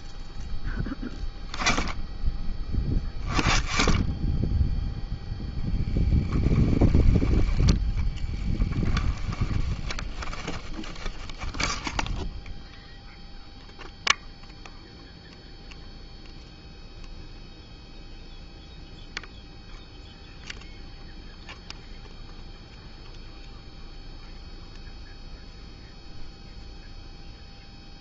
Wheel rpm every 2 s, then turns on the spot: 0, 10, 10, 10, 10, 10, 0, 0, 0, 0, 0, 0, 0, 0.
8-12